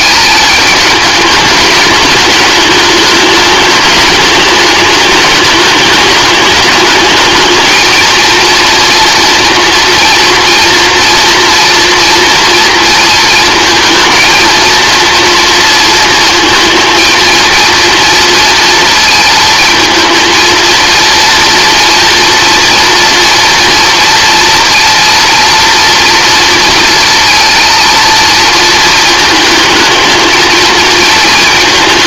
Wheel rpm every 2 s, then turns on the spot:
210, 210, 210, 210, 230, 230, 230, 230, 230, 230, 230, 230, 230, 230, 220, 220.
none